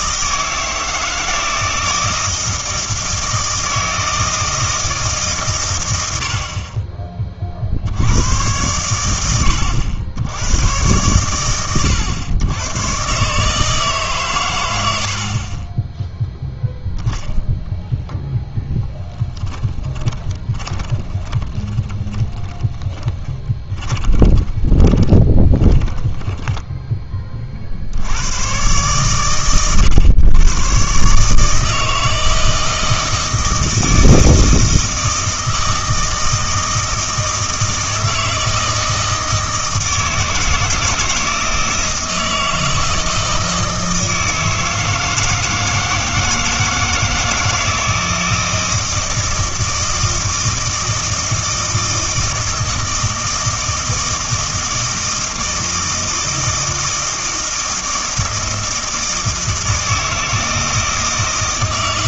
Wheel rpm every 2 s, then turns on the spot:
160, 160, 160, 40, 100, 110, 110, 110, 0, 10, 20, 20, 20, 10, 120, 120, 160, 160, 160, 160, 160, 160, 160, 160, 160, 160, 160, 160, 160, 160, 160.
20-26